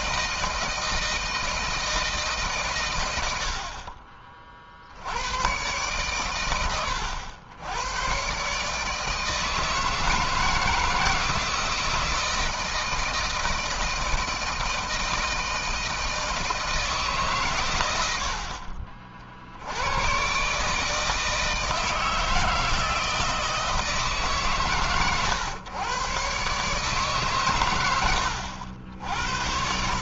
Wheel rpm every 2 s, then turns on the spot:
160, 110, 70, 100, 150, 160, 160, 160, 150, 50, 150, 160, 110, 140, 80.
none